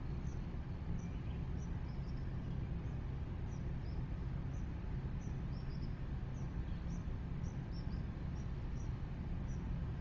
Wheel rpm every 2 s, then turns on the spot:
0, 0, 0, 0, 0.
none